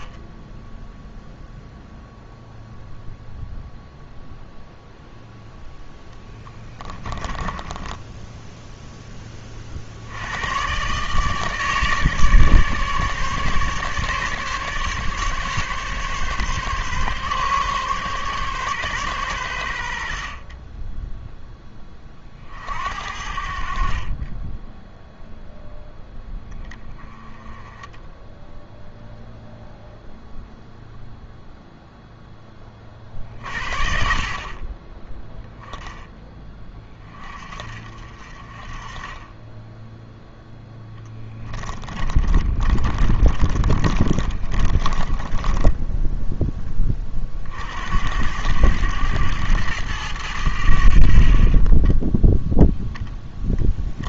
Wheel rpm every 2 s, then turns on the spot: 10, 0, 0, 10, 10, 120, 150, 140, 140, 140, 20, 60, 10, 20, 0, 0, 30, 20, 20, 30, 0, 30, 40, 20, 100, 70, 0.
42-46